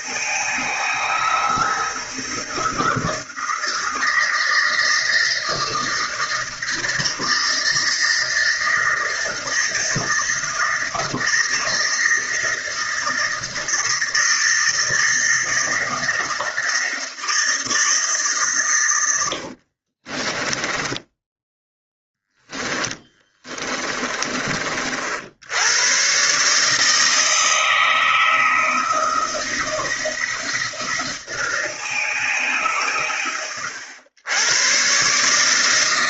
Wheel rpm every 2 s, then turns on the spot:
160, 160, 160, 160, 160, 160, 160, 160, 160, 100, 10, 10, 60, 160, 160, 170, 120, 130.
20-24